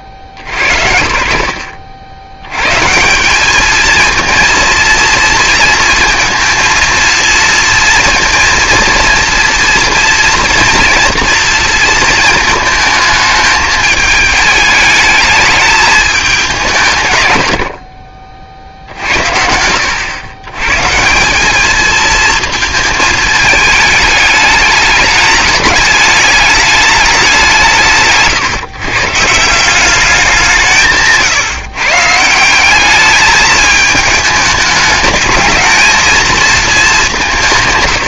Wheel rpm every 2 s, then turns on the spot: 50, 110, 230, 230, 230, 240, 220, 210, 170, 70, 130, 230, 210, 210, 140, 180, 180, 210, 220.
none